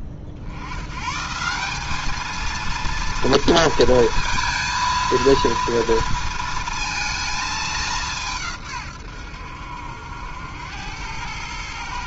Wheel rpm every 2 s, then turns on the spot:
80, 220, 230, 230, 150, 90.
none